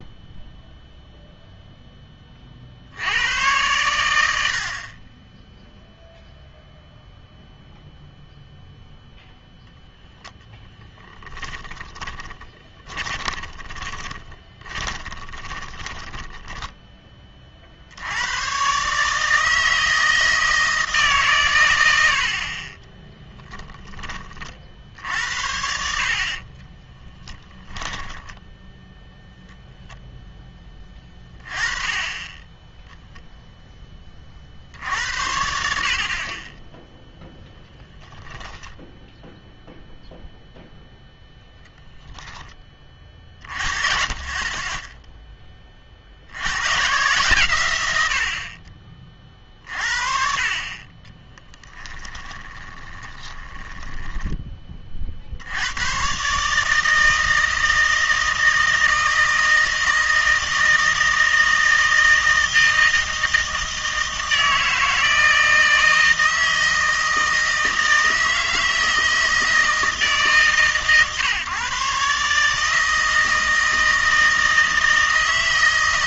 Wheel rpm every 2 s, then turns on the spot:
0, 60, 60, 0, 0, 10, 30, 20, 10, 130, 160, 30, 50, 30, 0, 10, 10, 60, 10, 0, 0, 20, 20, 110, 40, 40, 20, 30, 150, 160, 160, 160, 160, 160, 160, 140, 160, 160.
10-18 22-24 26-28 52-54